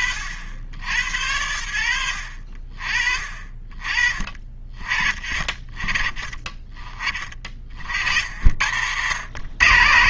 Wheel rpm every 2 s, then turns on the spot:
50, 40, 30, 30, 90.
none